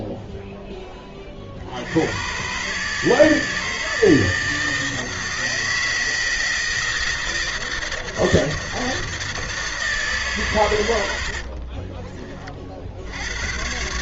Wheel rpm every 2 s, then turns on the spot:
0, 130, 160, 160, 160, 120, 40.
none